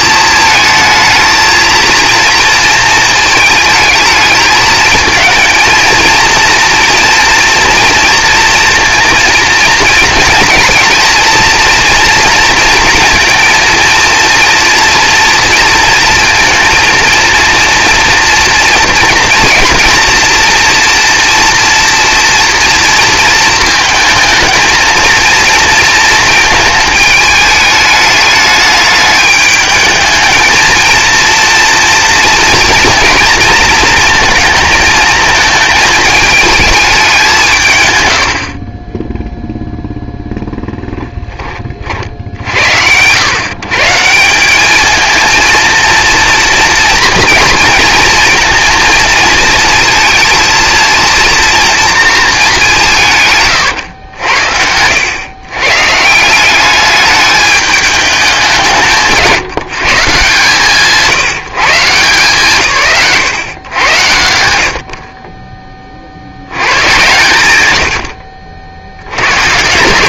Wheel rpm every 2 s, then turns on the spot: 220, 220, 220, 240, 230, 230, 230, 230, 230, 240, 230, 230, 230, 220, 210, 230, 230, 220, 210, 20, 10, 110, 220, 230, 230, 230, 180, 90, 200, 190, 130, 110, 50, 120, 70.
40-42